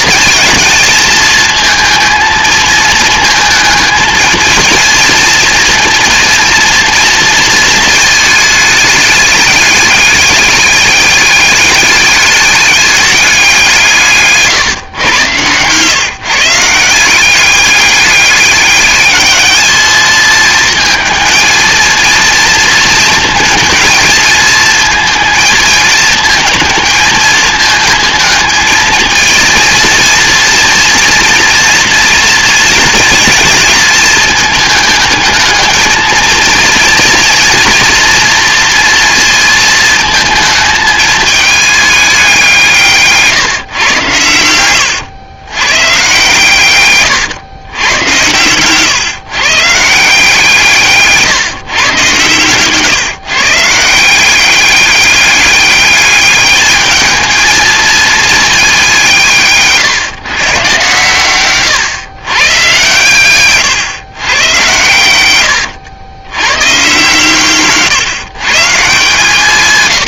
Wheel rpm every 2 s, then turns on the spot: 220, 220, 230, 230, 210, 200, 210, 130, 170, 210, 230, 230, 220, 220, 220, 230, 230, 220, 230, 230, 220, 160, 100, 120, 130, 160, 130, 200, 210, 200, 130, 120, 110, 120, 140.
none